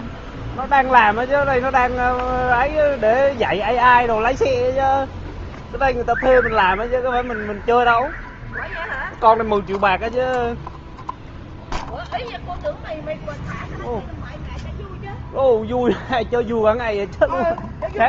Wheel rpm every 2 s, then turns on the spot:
0, 0, 0, 0, 0, 0, 0, 0, 0.
none